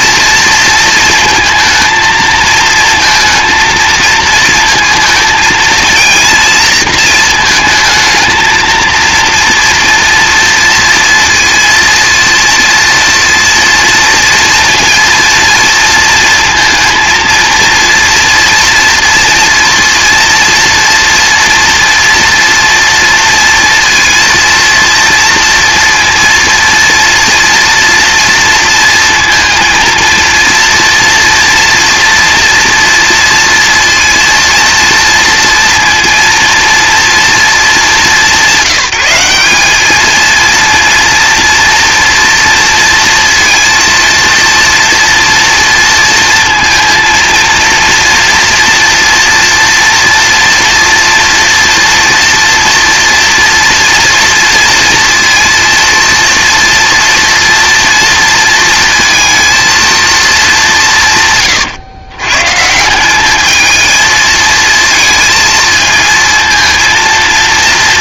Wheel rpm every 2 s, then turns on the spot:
230, 230, 230, 230, 230, 230, 230, 230, 230, 230, 230, 230, 230, 230, 230, 230, 230, 230, 230, 190, 230, 230, 230, 230, 230, 230, 230, 230, 230, 230, 190, 160, 220, 230.
none